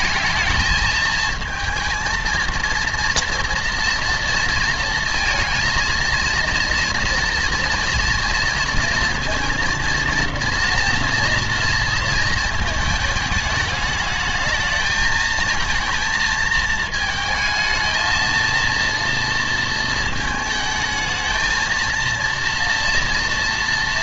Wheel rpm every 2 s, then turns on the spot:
220, 230, 230, 230, 230, 230, 220, 220, 230, 230, 220, 230.
none